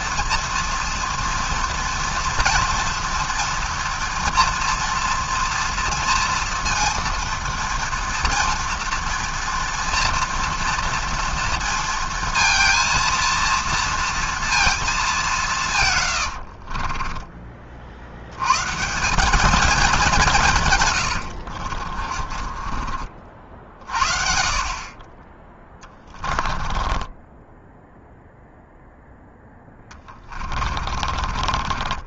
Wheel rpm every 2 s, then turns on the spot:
230, 230, 240, 230, 230, 230, 230, 230, 60, 120, 160, 30, 50, 20, 0, 30.
16-18 22-24 26-28 30-32